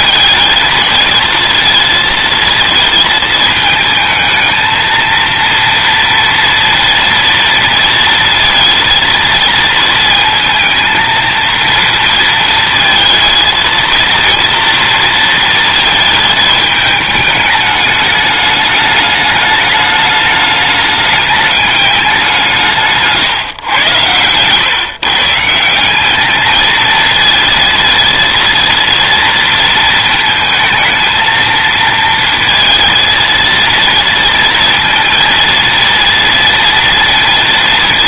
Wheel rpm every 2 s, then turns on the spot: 220, 230, 220, 230, 230, 230, 230, 230, 210, 210, 210, 170, 130, 220, 230, 220, 230, 230, 230.
none